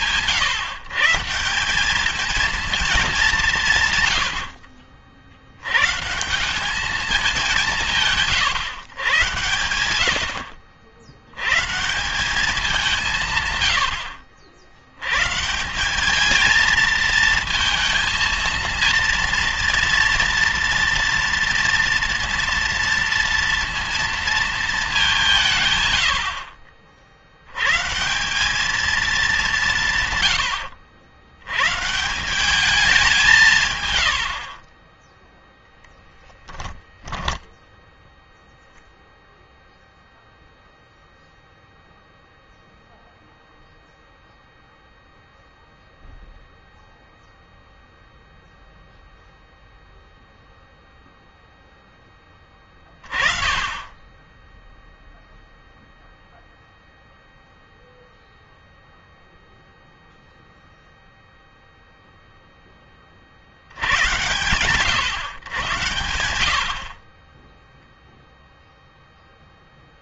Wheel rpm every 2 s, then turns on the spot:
150, 220, 60, 200, 130, 70, 190, 100, 220, 230, 230, 230, 220, 60, 210, 90, 190, 30, 10, 0, 0, 0, 0, 0, 0, 0, 20, 10, 0, 0, 0, 10, 110, 50, 0.
30-32 36-38